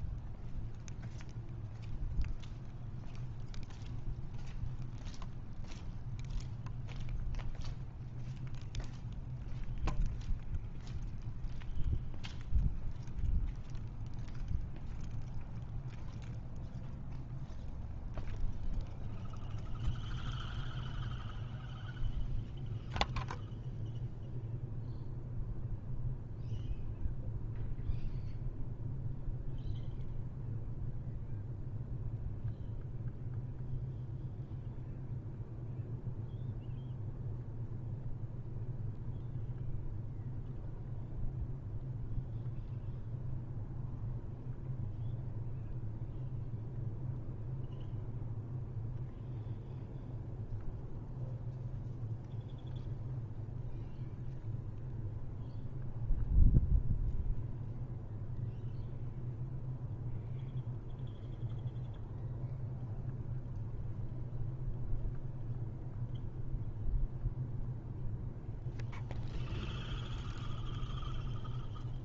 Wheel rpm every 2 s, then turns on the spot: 0, 0, 0, 0, 0, 0, 0, 0, 0, 0, 0, 0, 0, 0, 0, 0, 0, 0, 0, 0, 0, 0, 0, 0, 0, 0, 0, 0, 0, 0, 0, 0, 0, 0, 0, 0.
none